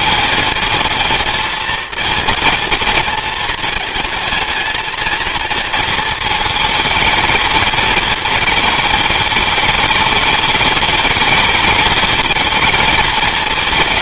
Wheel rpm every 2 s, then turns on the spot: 230, 230, 220, 220, 220, 210, 210.
none